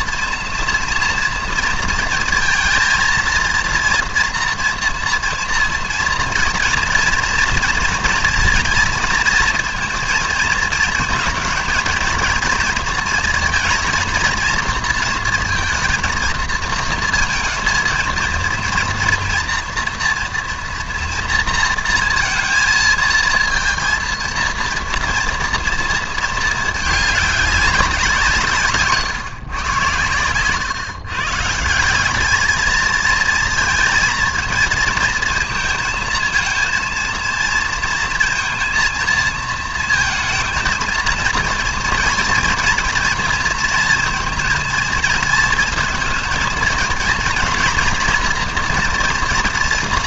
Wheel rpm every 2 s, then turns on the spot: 230, 230, 230, 230, 220, 230, 230, 230, 230, 230, 230, 230, 230, 220, 150, 130, 220, 220, 230, 230, 230, 230, 230, 230, 240.
none